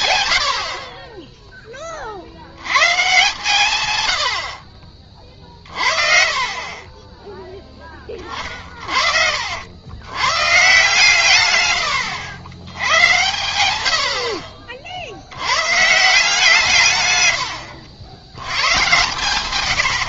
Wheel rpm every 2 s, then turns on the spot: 70, 100, 50, 40, 40, 140, 100, 50, 160, 110.
none